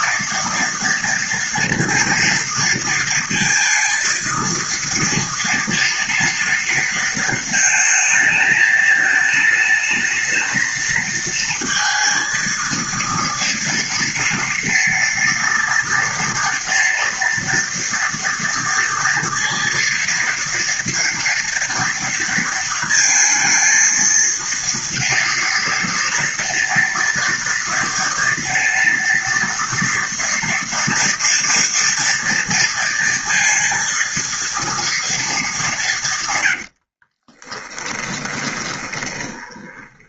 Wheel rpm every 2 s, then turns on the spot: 230, 230, 230, 230, 220, 220, 230, 230, 230, 230, 230, 230, 230, 230, 230, 230, 230, 230, 90, 20.
36-40